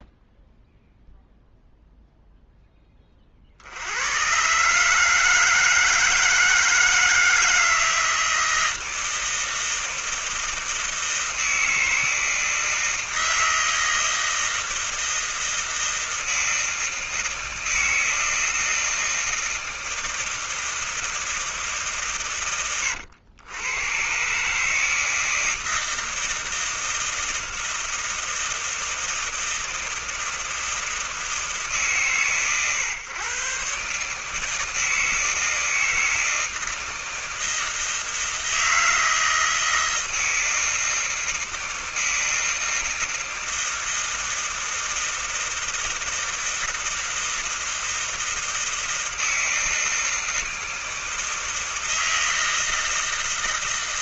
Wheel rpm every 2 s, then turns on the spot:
0, 0, 90, 160, 160, 160, 160, 160, 160, 160, 160, 140, 120, 160, 160, 160, 140, 150, 160, 160, 160, 160, 160, 170, 160, 160, 160.
none